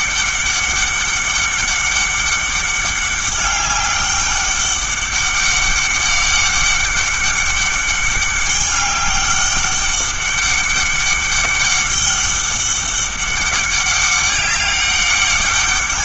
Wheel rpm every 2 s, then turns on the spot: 200, 200, 200, 200, 200, 200, 200, 200.
none